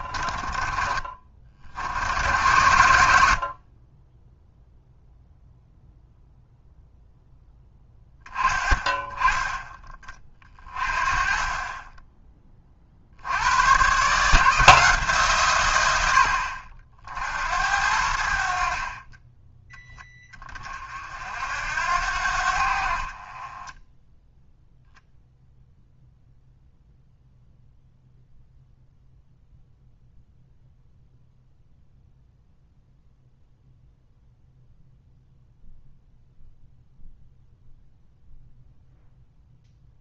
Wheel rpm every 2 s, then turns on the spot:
30, 80, 0, 0, 20, 30, 50, 150, 50, 40, 50, 50, 10, 0, 0, 0, 0, 0, 0, 0.
none